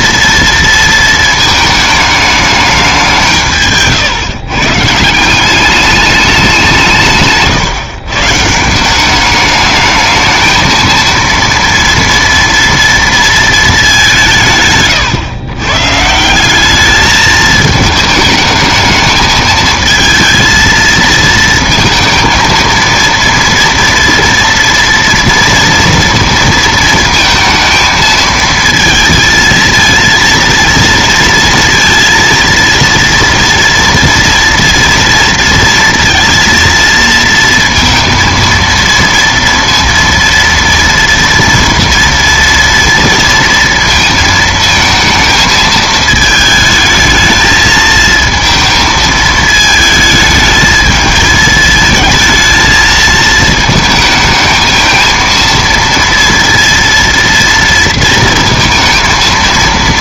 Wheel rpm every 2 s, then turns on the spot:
230, 210, 140, 190, 160, 220, 230, 150, 200, 210, 230, 230, 230, 230, 220, 230, 230, 240, 230, 230, 230, 230, 230, 220, 220, 220, 220, 220, 230, 230.
none